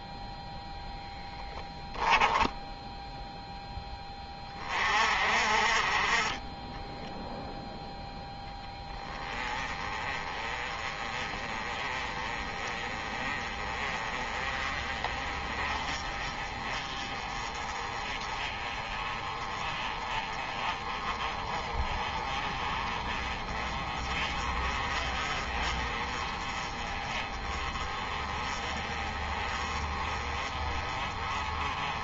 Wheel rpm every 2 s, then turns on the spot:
0, 0, 40, 10, 10, 20, 20, 30, 30, 30, 30, 30, 30, 30, 30, 30.
none